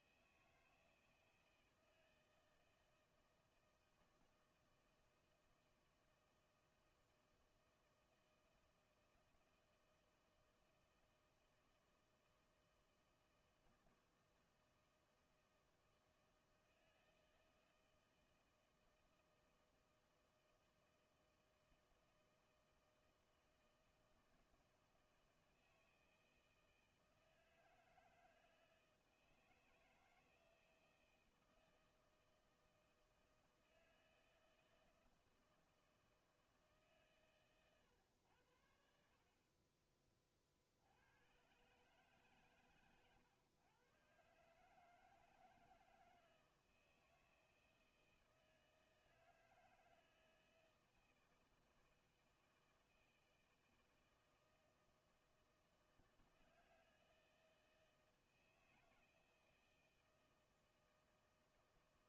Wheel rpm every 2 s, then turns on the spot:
160, 160, 160, 160, 160, 160, 160, 160, 160, 160, 170, 160, 160, 160, 160, 160, 160, 160, 160, 90, 40, 130, 140, 160, 160, 160, 160, 160, 160, 160, 160.
none